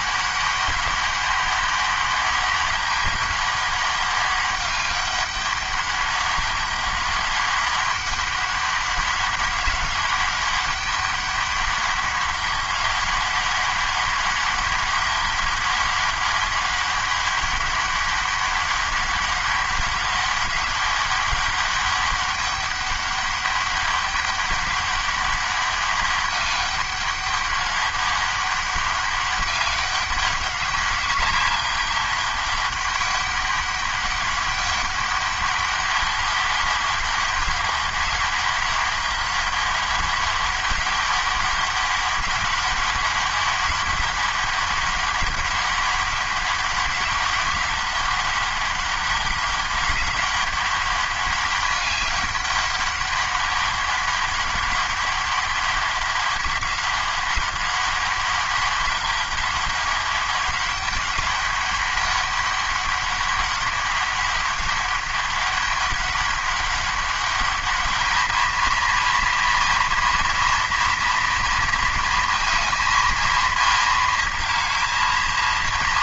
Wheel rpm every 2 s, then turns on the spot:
200, 200, 200, 200, 200, 200, 200, 200, 200, 200, 200, 200, 200, 200, 190, 200, 200, 190, 190, 200, 200, 200, 200, 200, 200, 200, 200, 200, 190, 200, 200, 200, 200, 200, 230, 230, 230, 220.
none